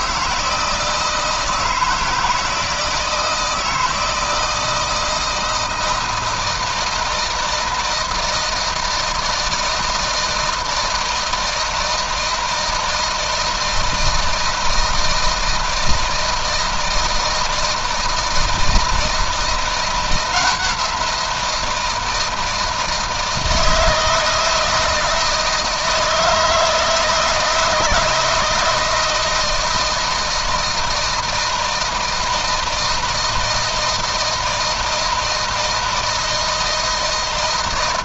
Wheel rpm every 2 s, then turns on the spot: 160, 160, 160, 160, 160, 160, 160, 160, 160, 160, 170, 160, 160, 160, 170, 160, 160, 160, 160.
none